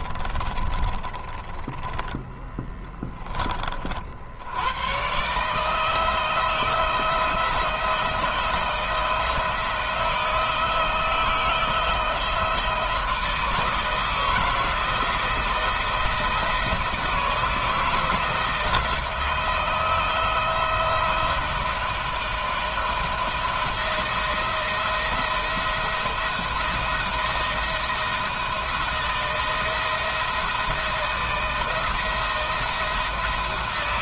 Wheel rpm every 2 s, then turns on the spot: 20, 10, 100, 160, 160, 160, 160, 170, 160, 160, 170, 160, 170, 170, 160, 160, 170.
0-4